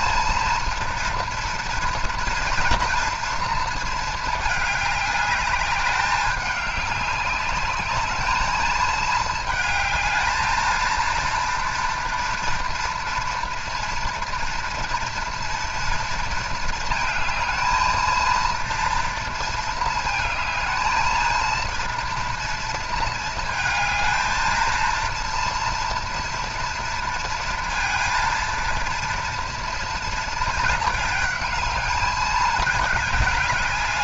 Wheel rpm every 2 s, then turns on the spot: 230, 230, 210, 200, 210, 220, 230, 230, 220, 230, 220, 230, 220, 230, 230, 220, 210.
none